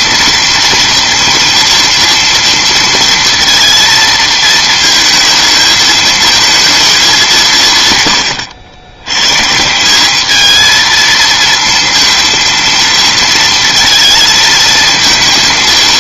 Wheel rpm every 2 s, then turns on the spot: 230, 230, 220, 220, 90, 220, 230, 230.
none